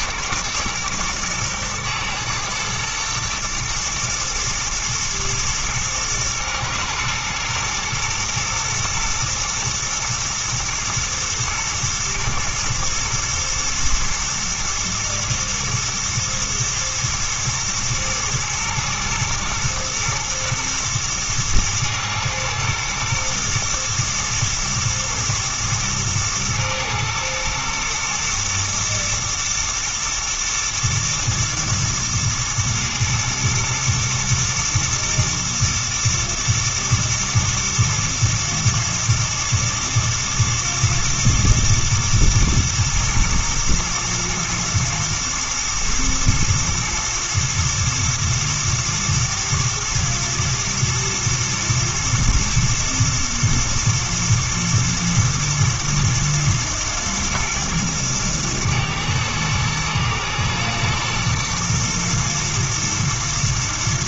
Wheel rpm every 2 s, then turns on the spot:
120, 110, 110, 120, 120, 110, 120, 120, 110, 110, 120, 120, 120, 110, 110, 120, 110, 120, 120, 110, 120, 110, 110, 120, 110, 110, 120, 110, 120, 110, 110, 120.
none